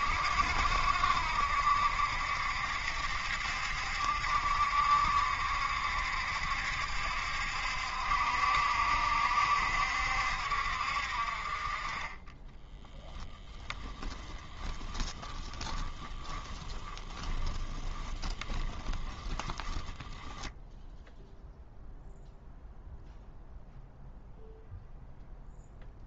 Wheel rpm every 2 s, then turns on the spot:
70, 70, 70, 70, 70, 60, 10, 10, 10, 10, 0, 0, 0.
12-20